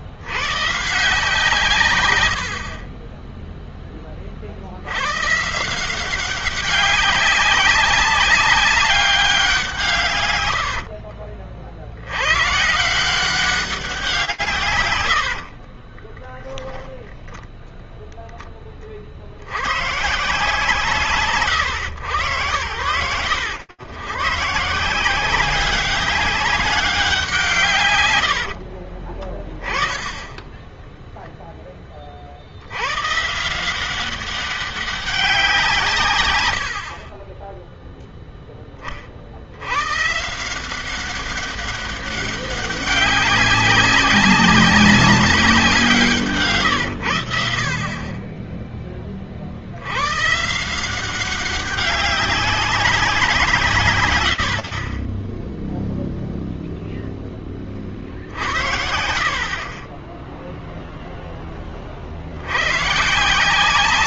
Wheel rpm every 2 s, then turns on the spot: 90, 80, 40, 190, 190, 110, 120, 150, 10, 20, 150, 100, 150, 200, 70, 10, 100, 200, 30, 20, 180, 200, 200, 130, 20, 170, 200, 50, 0, 60, 0, 110.
2-4 10-12 28-30